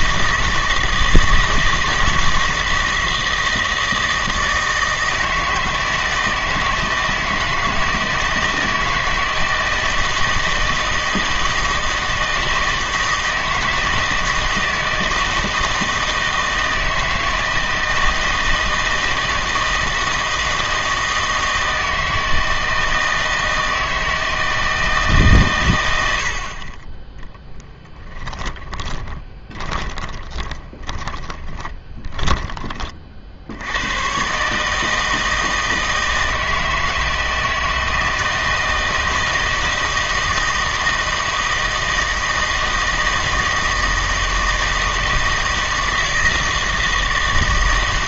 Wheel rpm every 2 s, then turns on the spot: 160, 160, 160, 160, 160, 160, 160, 160, 160, 160, 160, 160, 160, 30, 20, 30, 30, 150, 160, 160, 160, 160, 160, 160.
28-32